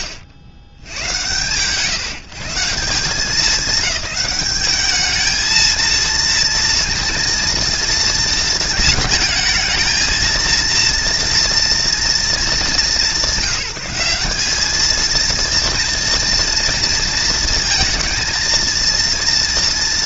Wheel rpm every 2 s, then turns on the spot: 70, 190, 210, 230, 220, 230, 190, 220, 230, 230.
none